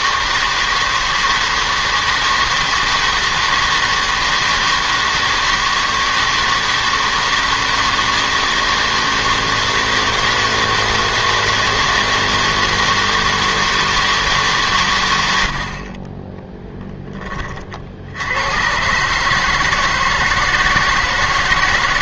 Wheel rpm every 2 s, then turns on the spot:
160, 160, 160, 160, 160, 160, 160, 140, 10, 110, 160.
none